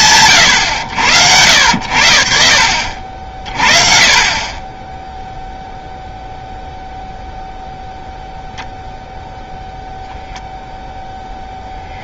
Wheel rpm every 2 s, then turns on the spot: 100, 60, 10, 0, 0, 0.
none